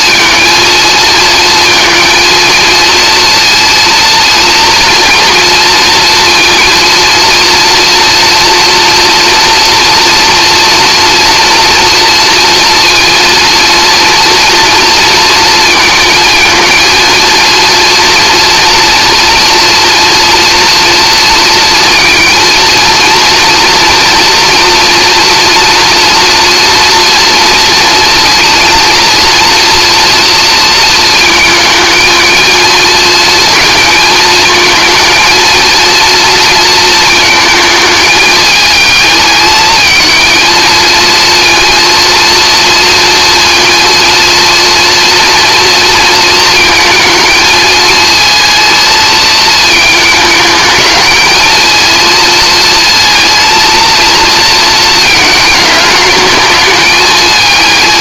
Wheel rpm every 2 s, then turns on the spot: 230, 230, 230, 230, 230, 230, 230, 230, 230, 230, 230, 230, 240, 230, 230, 230, 230, 230, 230, 220, 220, 230, 230, 230, 230, 220, 230, 230, 220.
none